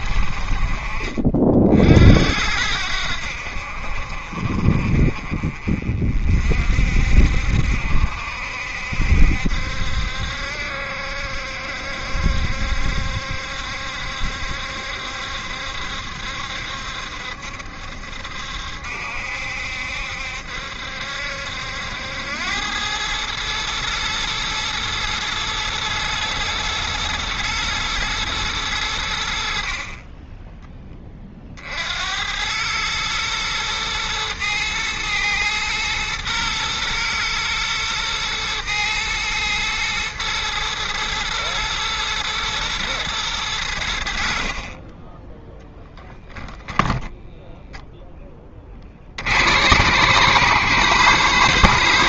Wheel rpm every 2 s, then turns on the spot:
40, 80, 50, 60, 70, 70, 70, 70, 70, 70, 70, 100, 120, 110, 100, 20, 110, 110, 110, 120, 110, 120, 20, 10, 40, 130.
44-48